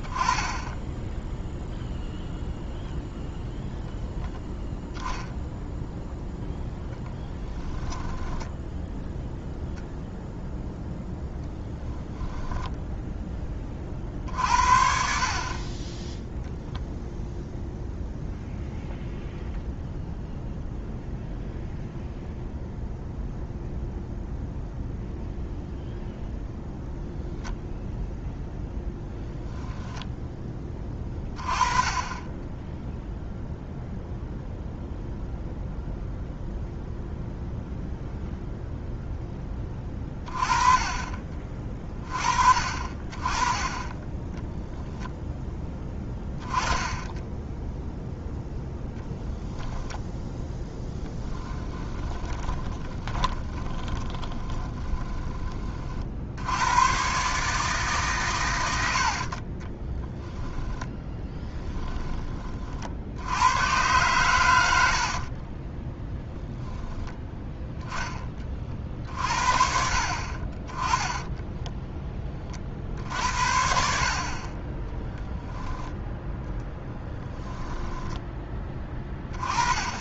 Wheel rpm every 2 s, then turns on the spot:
10, 0, 0, 0, 10, 0, 0, 60, 0, 0, 0, 0, 0, 0, 0, 20, 0, 0, 0, 0, 30, 40, 0, 10, 0, 10, 20, 20, 110, 90, 10, 50, 70, 0, 50, 20, 60, 20, 10, 20.
50-56 60-62 64-66 76-78